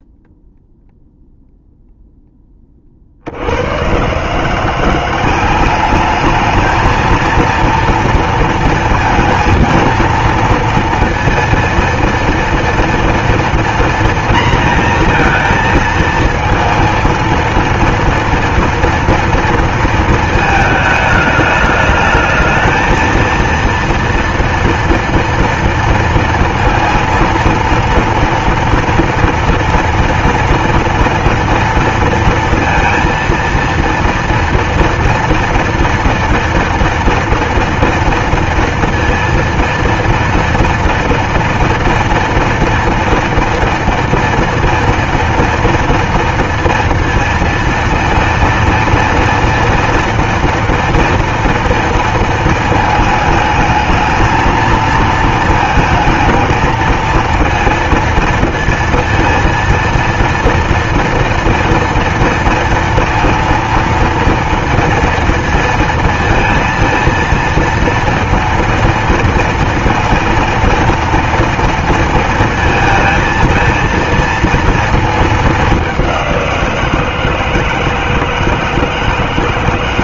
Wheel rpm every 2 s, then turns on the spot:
0, 20, 170, 210, 230, 230, 230, 230, 230, 230, 220, 220, 230, 230, 240, 230, 230, 240, 230, 230, 230, 230, 230, 230, 230, 230, 230, 220, 220, 230, 230, 230, 230, 230, 230, 230, 230, 220, 170, 160.
none